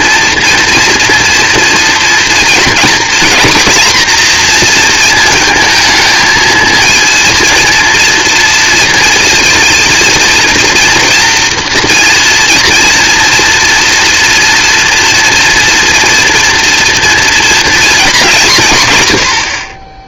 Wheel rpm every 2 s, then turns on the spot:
230, 230, 230, 230, 230, 230, 230, 240, 230, 130.
none